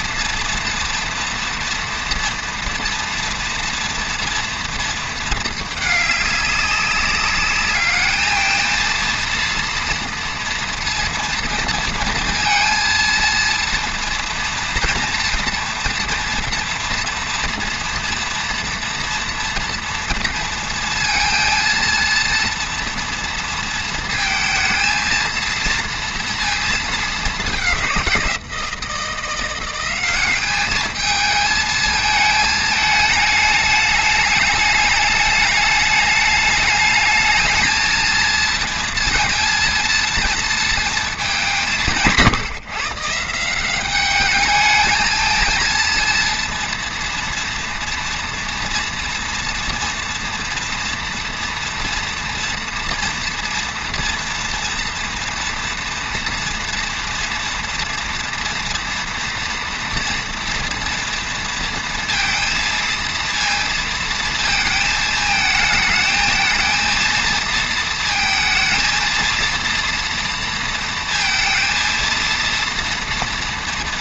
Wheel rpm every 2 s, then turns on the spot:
240, 230, 220, 200, 230, 230, 230, 230, 230, 230, 230, 230, 230, 210, 170, 220, 220, 210, 220, 230, 210, 160, 220, 230, 230, 230, 230, 230, 230, 230, 230, 230, 220, 230, 230, 230, 240.
none